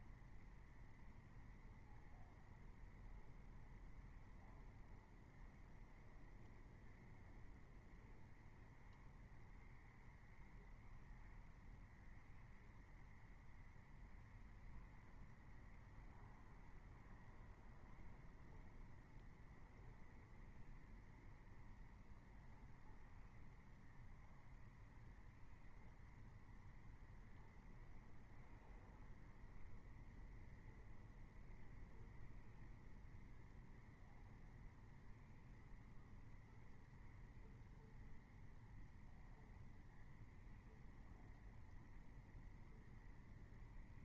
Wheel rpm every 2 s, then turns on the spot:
0, 0, 0, 0, 0, 0, 0, 0, 0, 0, 0, 0, 0, 0, 0, 0, 0, 0, 0, 0, 0, 0.
none